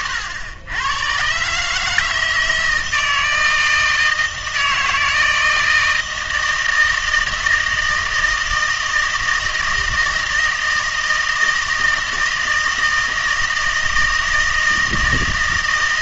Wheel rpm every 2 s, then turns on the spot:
110, 160, 160, 160, 160, 160, 160, 160.
none